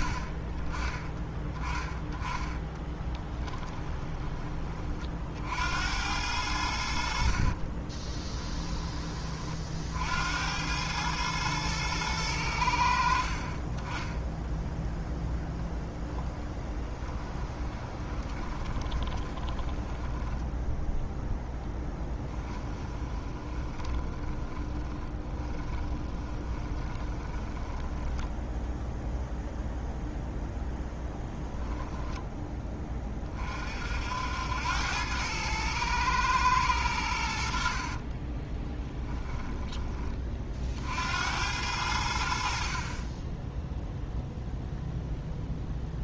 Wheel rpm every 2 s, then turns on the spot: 20, 20, 30, 80, 20, 100, 50, 0, 10, 20, 0, 20, 10, 20, 0, 0, 20, 90, 100, 10, 60, 40, 0.
2-4 18-20 22-28 38-40